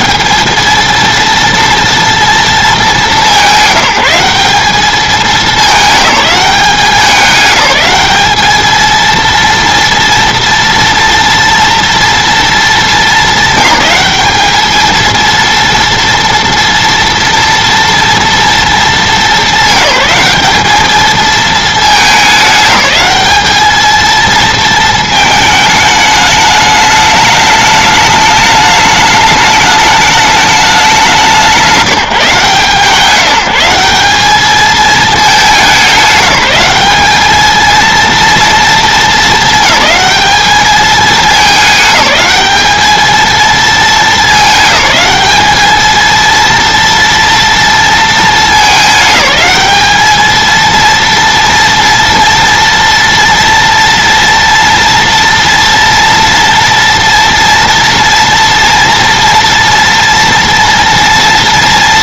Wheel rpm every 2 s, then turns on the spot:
220, 220, 200, 200, 220, 240, 220, 210, 230, 230, 210, 210, 220, 210, 210, 200, 160, 210, 200, 220, 210, 210, 210, 230, 210, 230, 240, 230, 230, 230, 230.
none